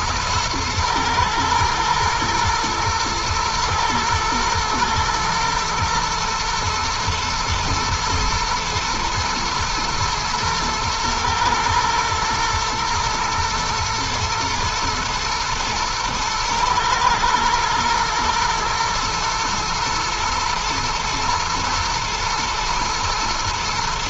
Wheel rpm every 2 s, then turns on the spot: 110, 110, 120, 120, 110, 110, 120, 110, 110, 110, 120, 120.
none